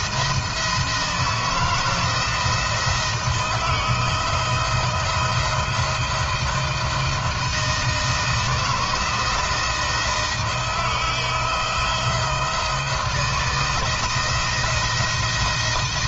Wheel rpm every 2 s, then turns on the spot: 160, 170, 160, 160, 170, 170, 170, 170.
none